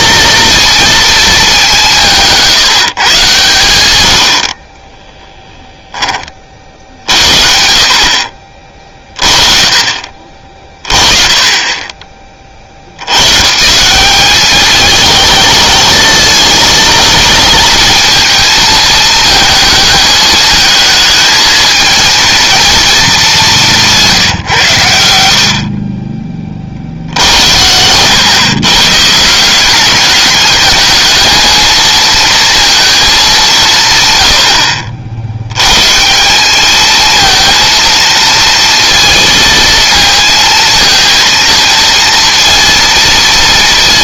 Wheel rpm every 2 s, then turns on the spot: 230, 150, 20, 70, 40, 20, 90, 210, 230, 220, 220, 210, 80, 70, 140, 210, 220, 60, 210, 230, 230, 230.
none